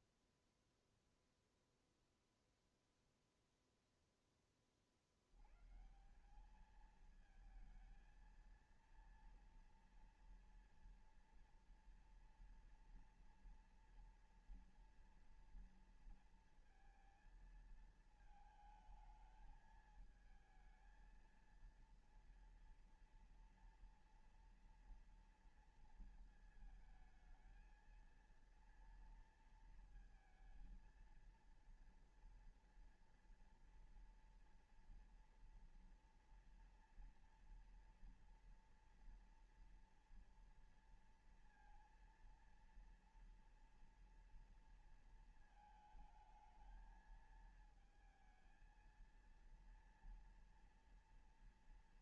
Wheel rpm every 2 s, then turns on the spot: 0, 0, 10, 180, 220, 230, 230, 230, 230, 220, 220, 230, 230, 220, 230, 230, 230, 230, 230, 240, 230, 230, 230, 220, 230, 230.
none